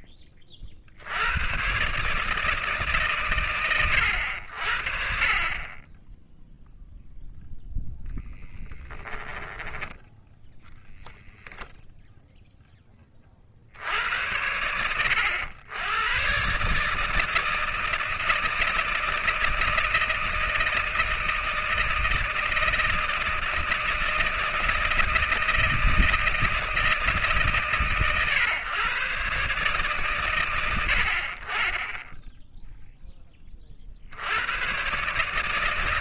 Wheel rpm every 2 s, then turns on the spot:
50, 110, 50, 0, 10, 0, 70, 100, 160, 160, 160, 160, 160, 140, 130, 30, 30, 150.
8-10